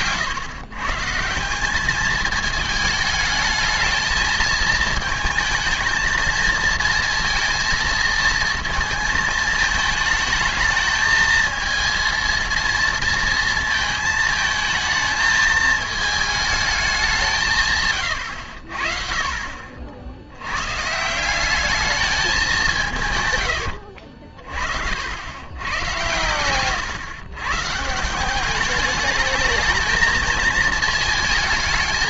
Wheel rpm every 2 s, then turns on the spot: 120, 220, 220, 230, 230, 220, 230, 220, 210, 60, 130, 180, 50, 120, 200, 220.
none